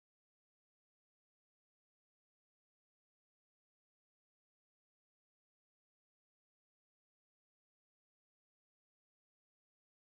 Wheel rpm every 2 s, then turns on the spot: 0, 0, 0, 0, 0.
none